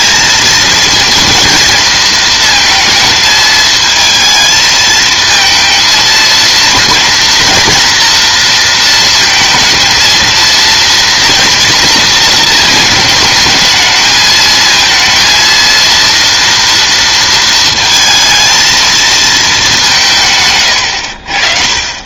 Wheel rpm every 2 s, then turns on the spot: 230, 230, 220, 230, 230, 230, 220, 220, 230, 220, 120.
20-22